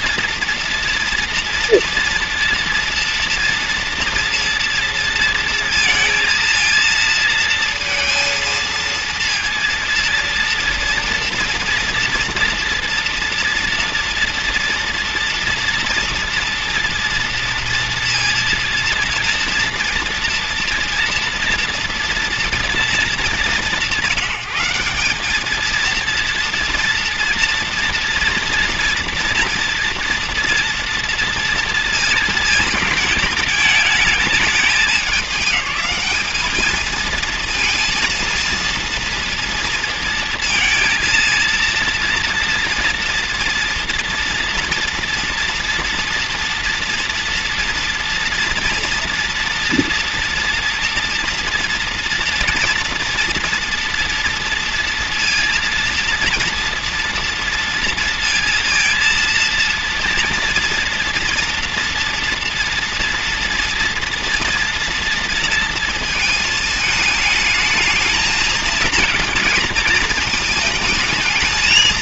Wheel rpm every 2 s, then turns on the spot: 230, 230, 230, 230, 230, 230, 230, 230, 230, 230, 230, 230, 190, 230, 230, 230, 220, 210, 220, 230, 230, 230, 240, 230, 240, 230, 240, 240, 230, 230, 230, 230, 230, 220, 220, 220.
none